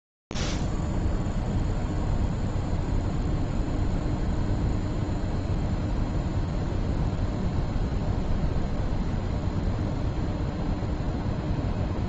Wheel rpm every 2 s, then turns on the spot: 0, 0, 0, 0, 0, 0.
none